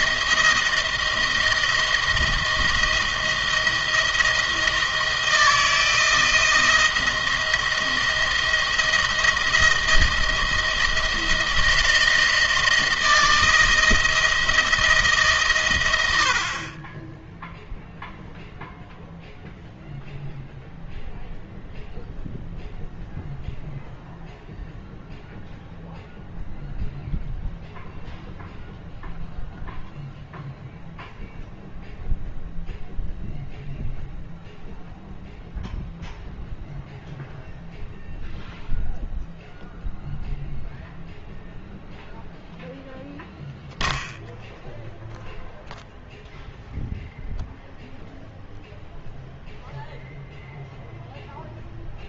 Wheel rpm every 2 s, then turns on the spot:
170, 170, 160, 160, 160, 160, 160, 160, 40, 0, 0, 0, 0, 0, 0, 0, 0, 0, 0, 0, 0, 0, 0, 0, 0, 0.
none